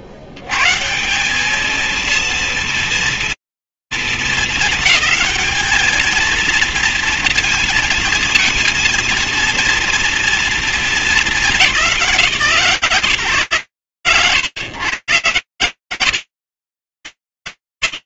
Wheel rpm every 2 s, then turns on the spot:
10, 190, 230, 220, 230, 230, 180, 120, 110.
none